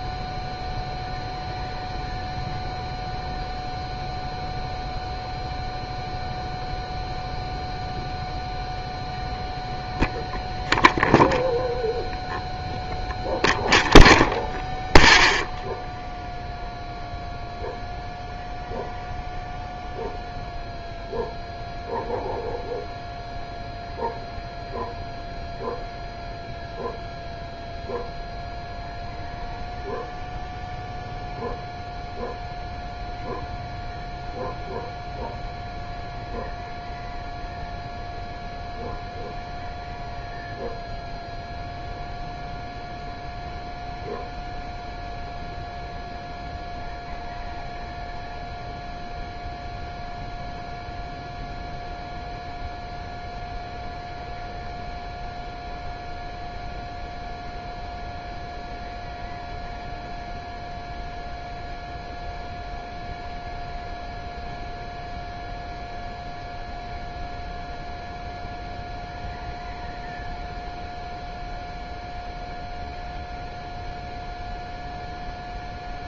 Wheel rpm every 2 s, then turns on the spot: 0, 0, 0, 0, 0, 0, 0, 0, 0, 0, 0, 0, 0, 0, 0, 0, 0, 0, 0, 0, 0, 0, 0, 0, 0, 0, 0, 0, 0, 0, 0, 0, 0, 0, 0, 0, 0, 0.
none